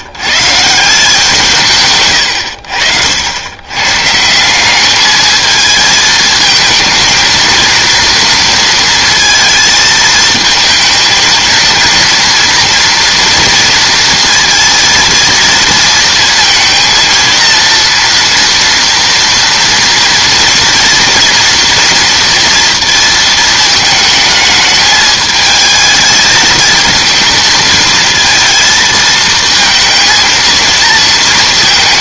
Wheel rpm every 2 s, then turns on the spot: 170, 70, 200, 220, 230, 220, 230, 230, 230, 230, 230, 230, 220, 220, 230, 230.
none